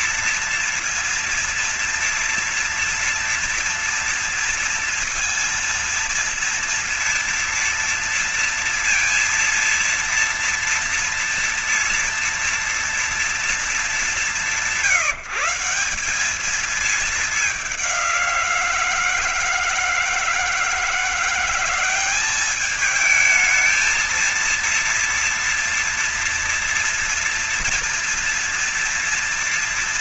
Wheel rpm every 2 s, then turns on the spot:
230, 230, 230, 230, 230, 230, 230, 170, 210, 170, 170, 210, 230, 230, 230.
none